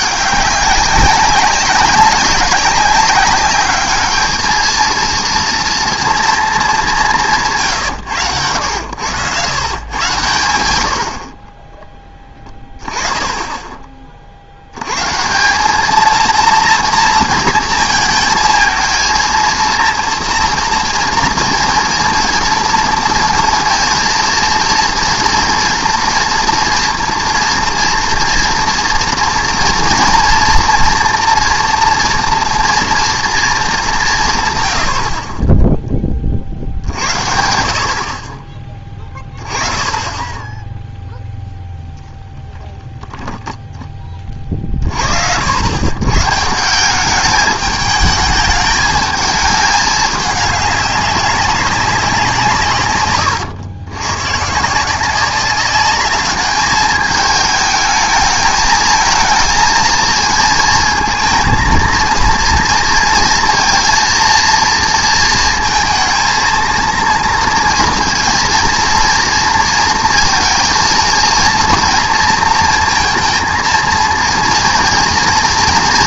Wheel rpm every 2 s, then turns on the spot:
190, 190, 220, 220, 90, 90, 10, 80, 230, 220, 230, 230, 230, 230, 230, 230, 230, 120, 70, 20, 10, 0, 40, 170, 210, 210, 140, 160, 210, 220, 230, 230, 230, 230, 240, 230, 230, 230.
none